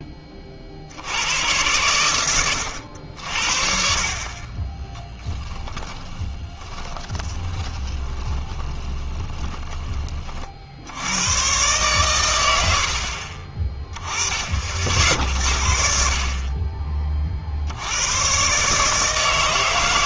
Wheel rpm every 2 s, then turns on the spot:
70, 80, 20, 20, 20, 70, 70, 60, 30, 150.
4-10